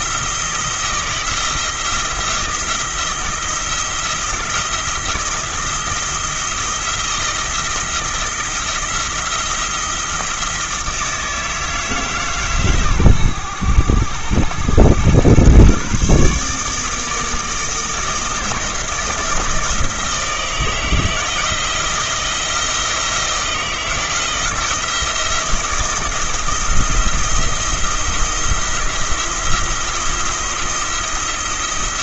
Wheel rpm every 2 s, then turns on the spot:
170, 170, 160, 170, 170, 160, 130, 110, 150, 170, 160, 170, 170, 170, 170, 170.
none